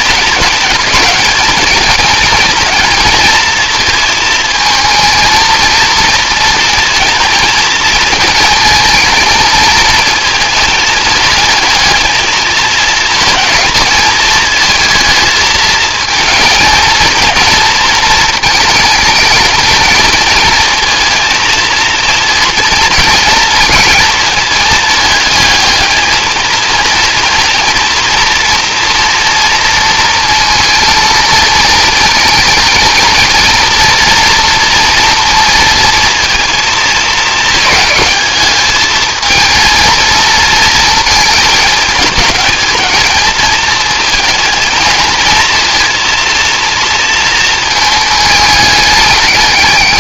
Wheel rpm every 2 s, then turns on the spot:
210, 220, 220, 230, 220, 220, 220, 220, 230, 220, 220, 230, 220, 230, 230, 230, 230, 230, 220, 220, 230, 220, 230, 230, 210.
none